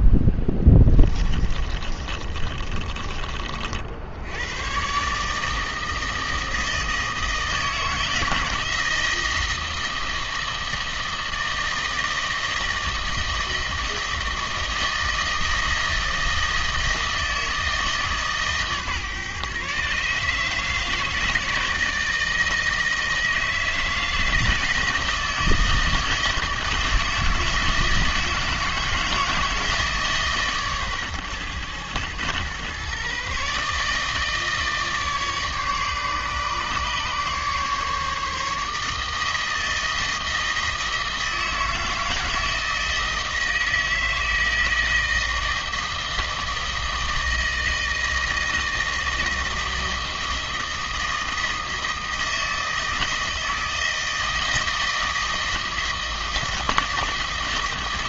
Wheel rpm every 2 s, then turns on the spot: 20, 30, 110, 160, 160, 160, 160, 160, 160, 140, 150, 160, 160, 160, 160, 140, 120, 150, 140, 150, 160, 160, 160, 160, 160, 160, 160, 160, 160.
0-4